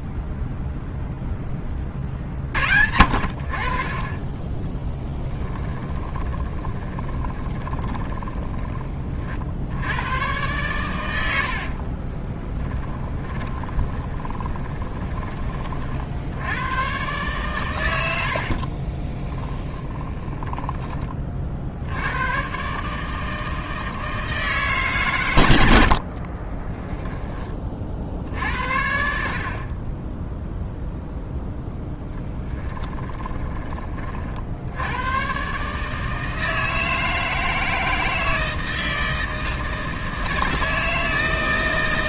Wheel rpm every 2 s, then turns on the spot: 90, 0, 0, 20, 40, 10, 60, 40, 30, 80, 20, 140, 140, 10, 70, 0, 10, 80, 160, 160, 160.
6-8 10-12 14-16 20-22 26-28 32-34